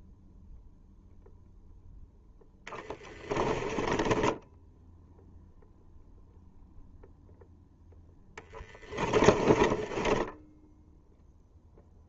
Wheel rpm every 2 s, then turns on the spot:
0, 20, 0, 0, 20, 0.
2-4 8-10